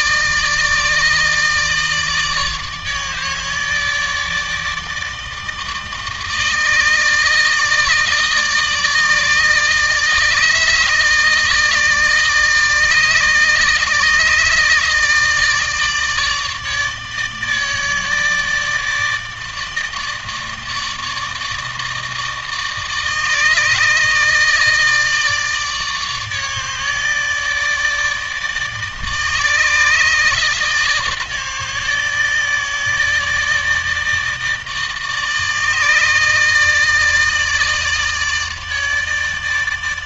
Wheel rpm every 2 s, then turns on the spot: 160, 150, 160, 160, 150, 150, 160, 150, 150, 160, 160, 150, 150, 150, 150, 150, 160, 150, 150, 150.
none